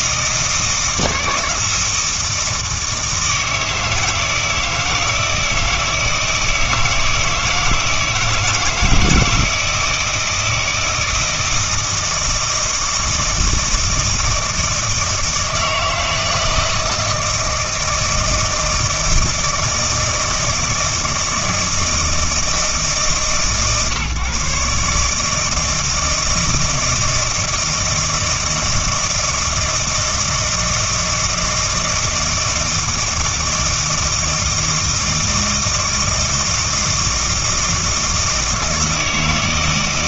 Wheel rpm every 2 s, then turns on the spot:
160, 160, 160, 160, 160, 160, 160, 160, 160, 160, 160, 150, 140, 160, 160, 160, 160, 160, 160, 160.
none